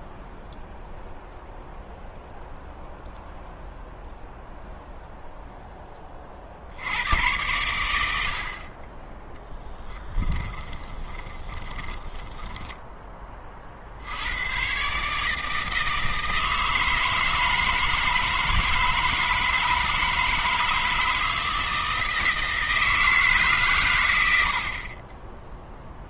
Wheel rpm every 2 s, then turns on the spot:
0, 0, 0, 60, 40, 10, 10, 120, 160, 160, 160, 160, 70.
10-14